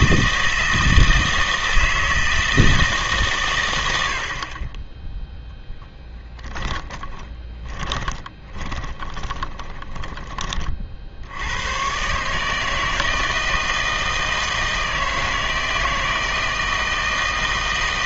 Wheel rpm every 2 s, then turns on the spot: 160, 160, 30, 20, 20, 30, 150, 160, 160.
6-10